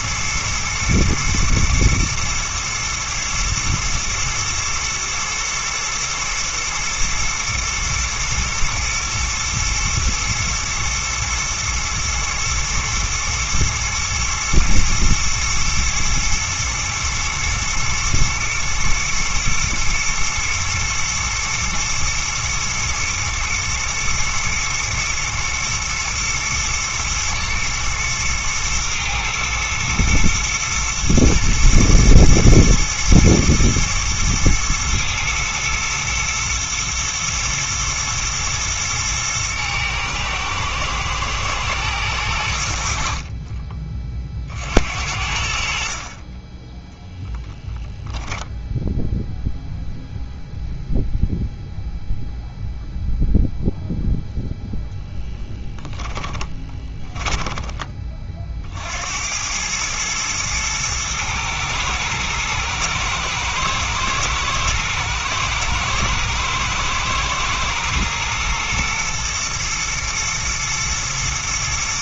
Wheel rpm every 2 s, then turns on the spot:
120, 120, 110, 110, 120, 120, 110, 120, 110, 120, 110, 120, 110, 110, 110, 110, 120, 110, 110, 120, 110, 80, 50, 10, 0, 0, 0, 0, 20, 60, 110, 110, 110, 110, 120, 120.
56-58